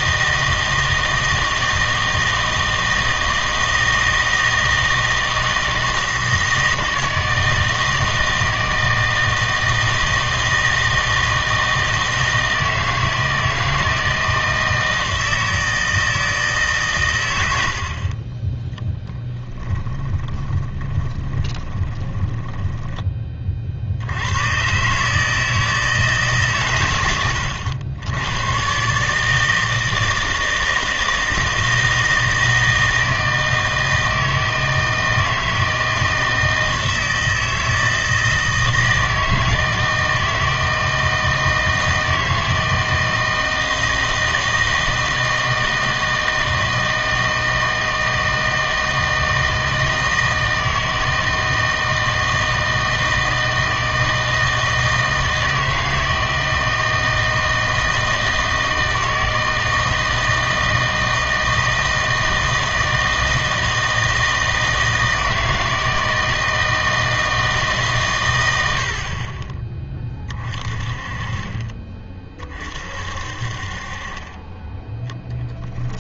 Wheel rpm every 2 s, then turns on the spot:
160, 160, 160, 160, 160, 160, 160, 160, 150, 20, 20, 10, 130, 130, 130, 160, 160, 160, 160, 160, 160, 160, 160, 160, 160, 160, 160, 160, 160, 160, 160, 160, 160, 160, 70, 30, 40, 20.
18-24